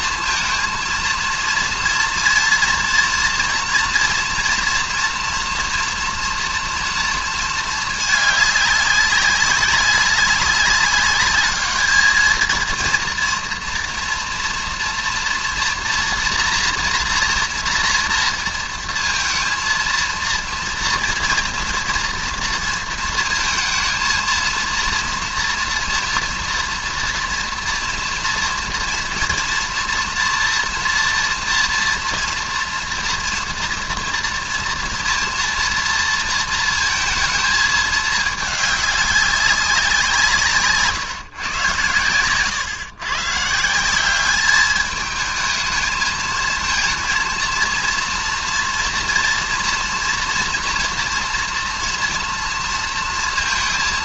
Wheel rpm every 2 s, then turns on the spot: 230, 230, 230, 230, 200, 200, 230, 230, 240, 230, 230, 230, 230, 230, 240, 230, 230, 230, 230, 210, 160, 120, 210, 230, 230, 240, 230.
40-42